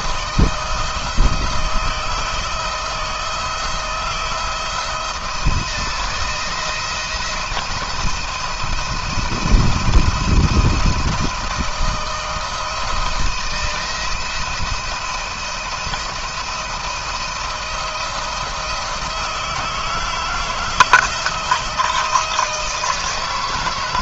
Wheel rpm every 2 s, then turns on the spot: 160, 160, 170, 170, 170, 170, 160, 170, 170, 170, 160, 160.
none